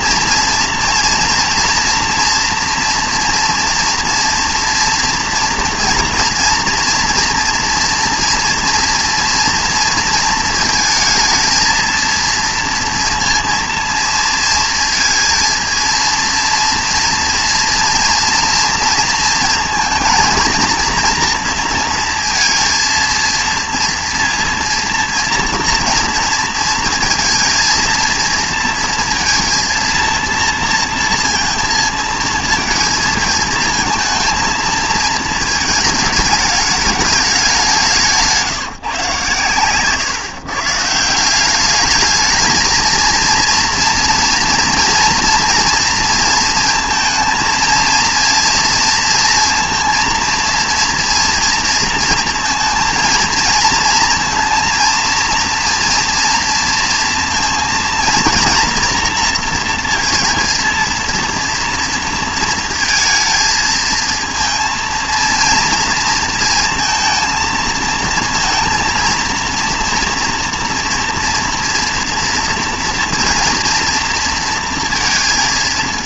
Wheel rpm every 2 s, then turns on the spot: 230, 230, 230, 230, 230, 230, 230, 230, 230, 230, 230, 230, 230, 220, 230, 230, 220, 230, 210, 150, 150, 220, 230, 230, 230, 230, 230, 230, 230, 230, 230, 230, 230, 230, 230, 230, 240, 230.
none